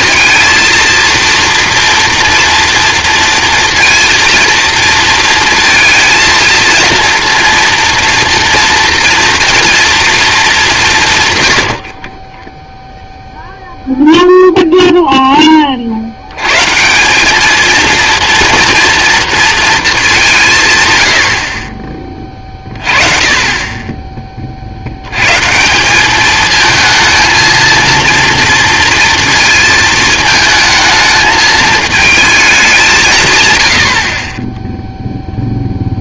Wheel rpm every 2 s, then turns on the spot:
230, 230, 230, 230, 230, 170, 0, 0, 180, 230, 110, 30, 100, 220, 230, 220, 160, 0.
none